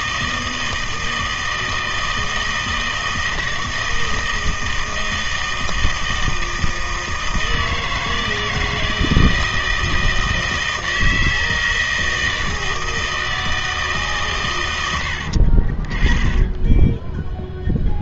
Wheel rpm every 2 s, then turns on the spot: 160, 160, 160, 160, 160, 160, 160, 110, 10.
16-18